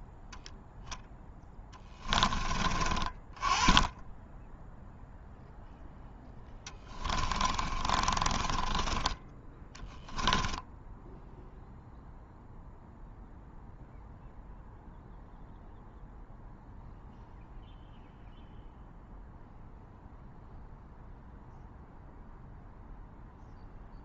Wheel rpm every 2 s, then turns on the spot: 0, 20, 0, 10, 30, 10, 0, 0, 0, 0, 0, 0.
6-12